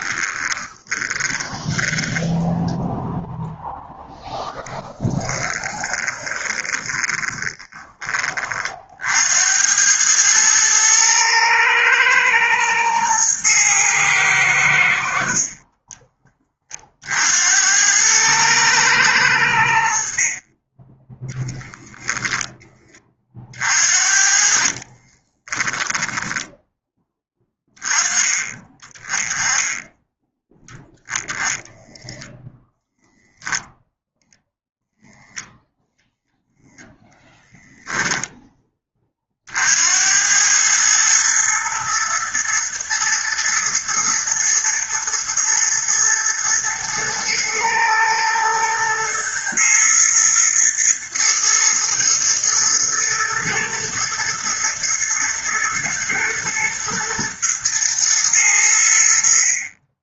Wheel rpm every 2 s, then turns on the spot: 20, 0, 20, 20, 70, 110, 110, 60, 60, 110, 20, 30, 40, 10, 30, 0, 0, 0, 10, 30, 110, 120, 120, 110, 110, 110, 120, 110, 110, 80.
0-2 6-8 24-26